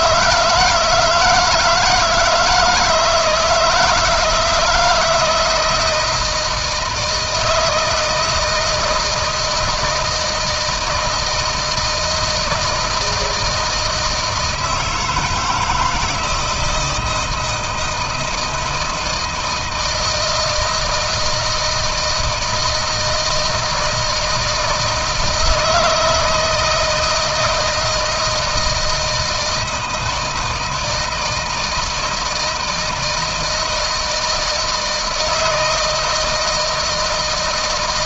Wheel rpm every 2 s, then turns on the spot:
160, 160, 170, 160, 160, 160, 160, 160, 160, 160, 160, 160, 160, 160, 160, 160, 160, 160, 160.
none